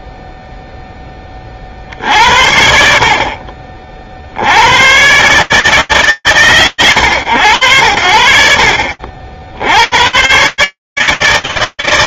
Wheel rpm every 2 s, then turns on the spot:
0, 30, 50, 130, 80, 110.
none